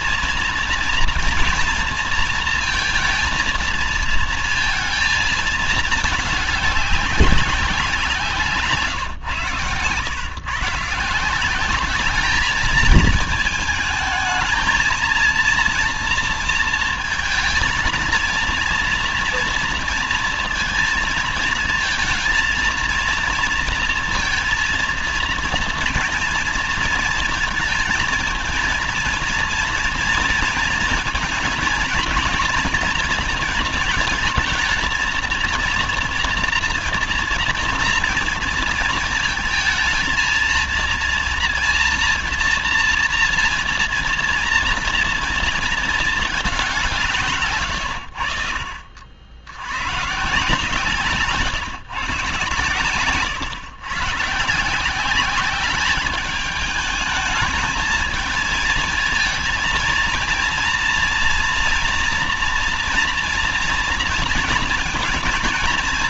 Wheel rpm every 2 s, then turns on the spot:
230, 230, 230, 200, 160, 150, 220, 230, 230, 230, 230, 230, 230, 230, 230, 230, 230, 230, 230, 230, 230, 230, 230, 180, 70, 150, 130, 160, 210, 220, 230, 230, 230.
8-10